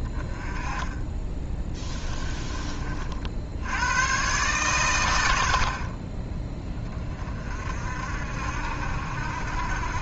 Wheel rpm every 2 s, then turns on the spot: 20, 30, 120, 20, 60.
none